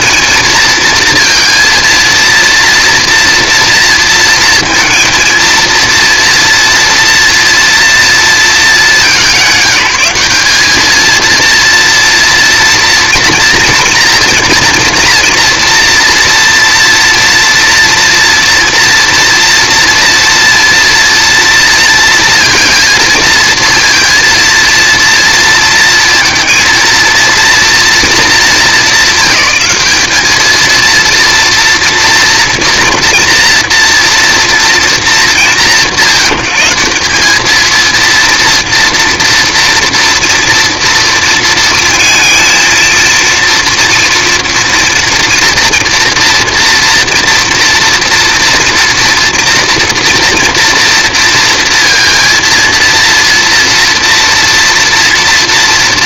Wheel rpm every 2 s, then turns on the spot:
230, 230, 230, 230, 210, 210, 230, 230, 240, 230, 230, 230, 230, 230, 200, 220, 230, 230, 170, 230, 240, 230, 230, 230, 230, 230, 230, 230.
none